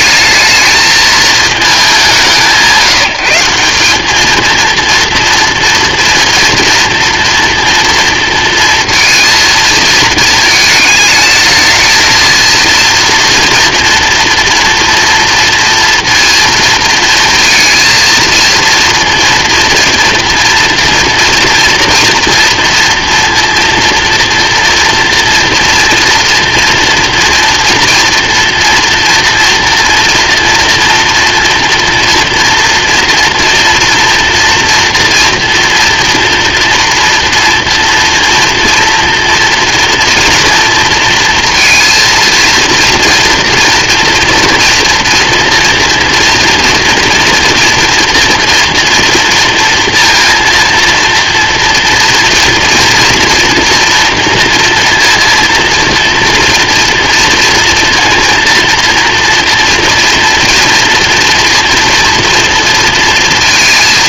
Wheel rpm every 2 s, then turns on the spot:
220, 160, 230, 230, 230, 220, 230, 240, 230, 230, 240, 230, 230, 230, 230, 230, 230, 230, 230, 240, 230, 230, 230, 230, 230, 230, 240, 230, 230, 230, 240, 230.
none